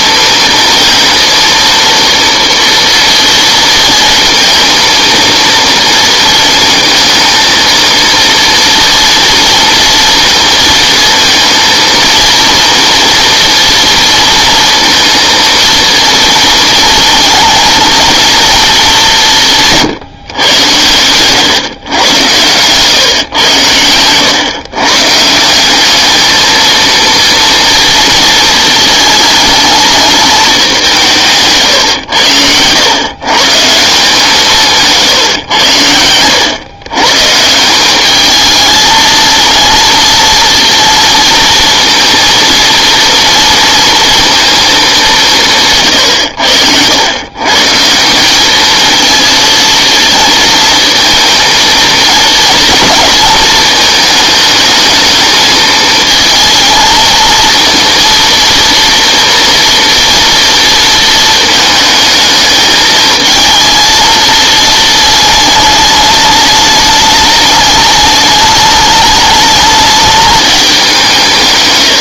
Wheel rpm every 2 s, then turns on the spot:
230, 230, 230, 220, 230, 230, 230, 230, 220, 220, 120, 120, 140, 230, 230, 200, 100, 160, 120, 220, 230, 230, 220, 80, 210, 230, 220, 220, 220, 230, 230, 220, 220, 210, 210, 200.
34-36